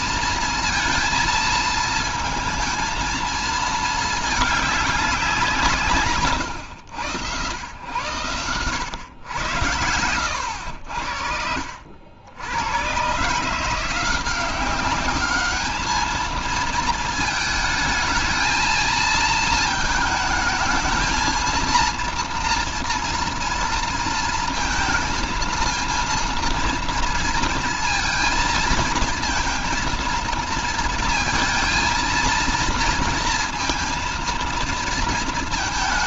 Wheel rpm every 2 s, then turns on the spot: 230, 230, 200, 90, 110, 80, 110, 190, 220, 220, 220, 230, 220, 230, 220, 230, 230, 230.
none